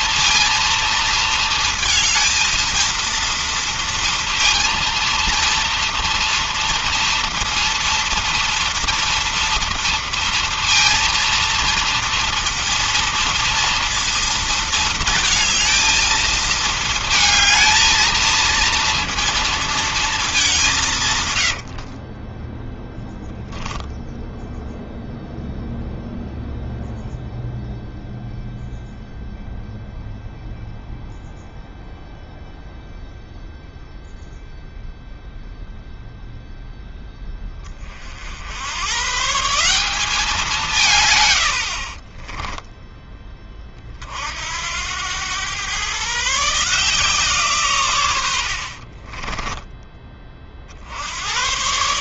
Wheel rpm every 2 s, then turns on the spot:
230, 230, 230, 230, 230, 230, 230, 230, 220, 230, 200, 20, 10, 0, 0, 0, 0, 0, 0, 90, 180, 20, 70, 150, 70, 40.
22-24 42-44